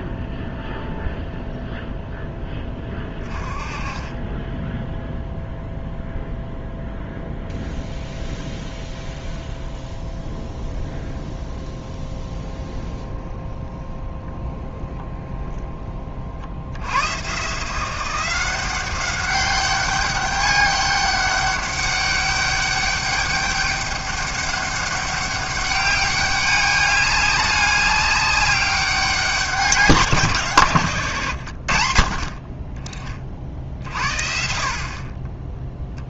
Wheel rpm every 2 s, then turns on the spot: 0, 10, 10, 0, 0, 0, 10, 0, 70, 180, 200, 200, 200, 200, 200, 130, 20, 50.
none